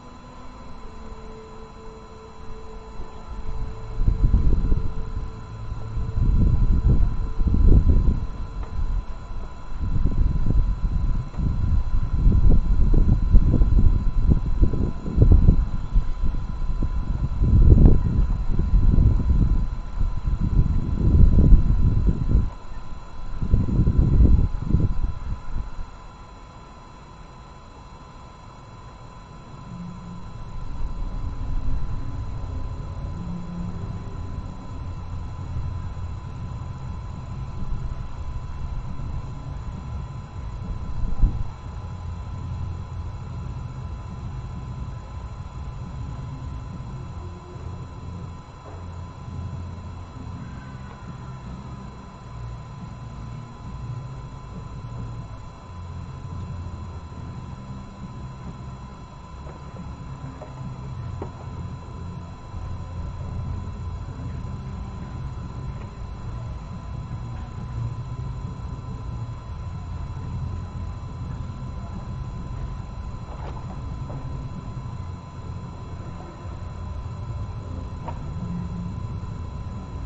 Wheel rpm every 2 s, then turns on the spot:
0, 0, 0, 0, 0, 0, 0, 0, 0, 0, 0, 0, 0, 0, 0, 0, 0, 0, 0, 0, 0, 0, 0, 0, 0, 0, 0, 0, 0, 0, 0, 0, 0, 0, 0, 0, 0, 0, 0, 0.
none